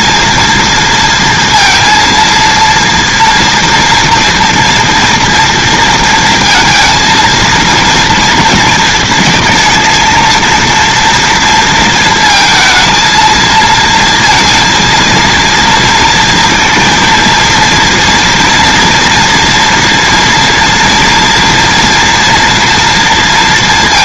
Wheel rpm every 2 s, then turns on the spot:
230, 230, 230, 230, 230, 230, 230, 230, 230, 230, 230, 240.
none